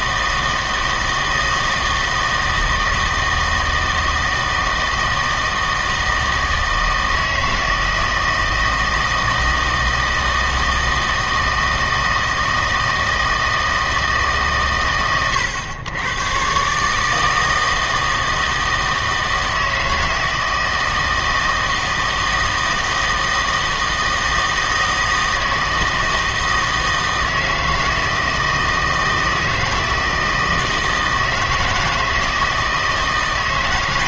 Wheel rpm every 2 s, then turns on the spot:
160, 160, 160, 160, 160, 160, 160, 130, 140, 160, 160, 160, 160, 160, 160, 160, 160.
none